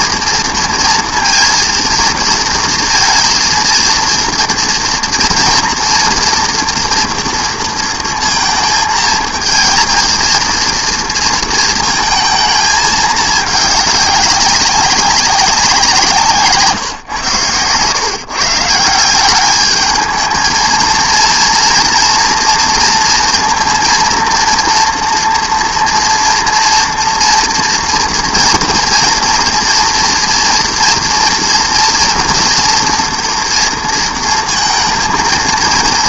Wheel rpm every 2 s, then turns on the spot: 230, 230, 230, 230, 220, 230, 220, 200, 150, 150, 230, 230, 230, 230, 230, 230, 230, 230.
none